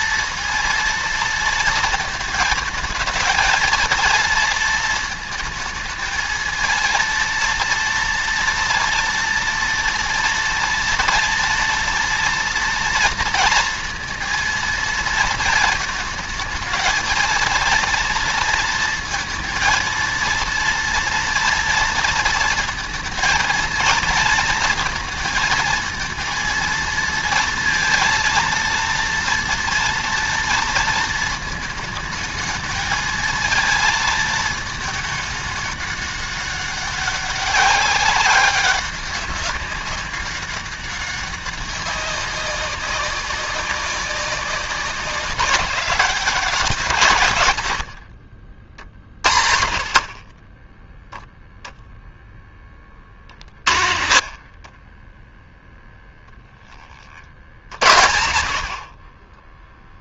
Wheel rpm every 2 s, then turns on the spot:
230, 220, 230, 220, 230, 240, 230, 230, 230, 230, 230, 230, 220, 230, 230, 230, 220, 220, 200, 190, 190, 200, 200, 160, 40, 10, 20, 20, 40, 30.
none